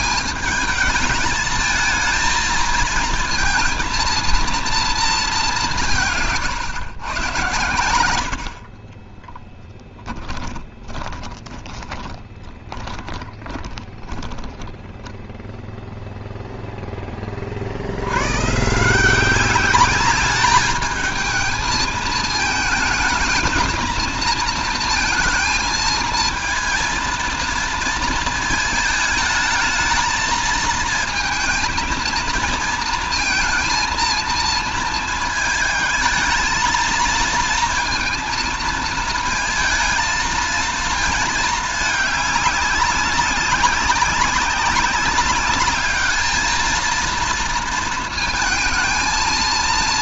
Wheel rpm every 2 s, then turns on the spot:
210, 230, 230, 140, 70, 30, 30, 10, 0, 140, 210, 220, 230, 230, 220, 220, 230, 230, 220, 220, 220, 200, 190, 220, 220.
8-16